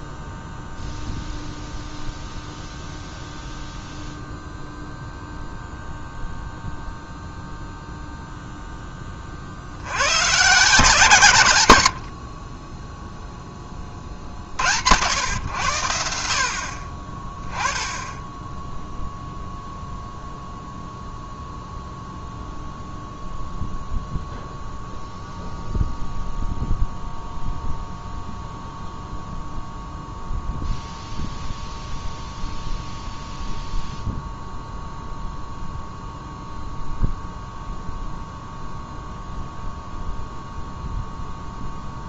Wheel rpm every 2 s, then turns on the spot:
0, 0, 0, 0, 0, 130, 30, 70, 50, 10, 0, 0, 0, 0, 0, 0, 0, 0, 0, 0, 0.
12-14